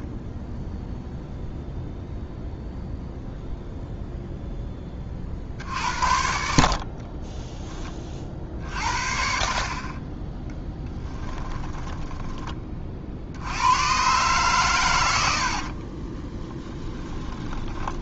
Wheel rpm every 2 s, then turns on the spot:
0, 0, 10, 60, 50, 10, 40, 110, 10.
10-12 16-18